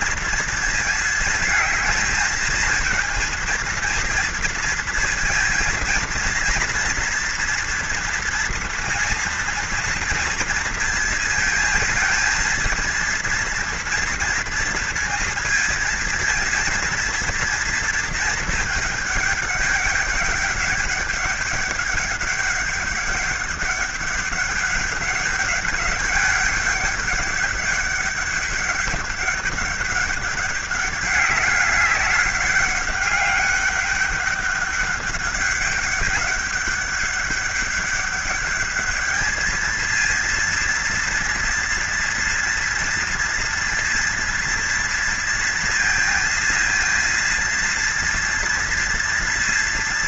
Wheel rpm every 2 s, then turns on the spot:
230, 230, 230, 230, 230, 230, 230, 230, 230, 220, 200, 200, 200, 200, 200, 200, 200, 200, 200, 210, 230, 230, 230, 230, 240.
none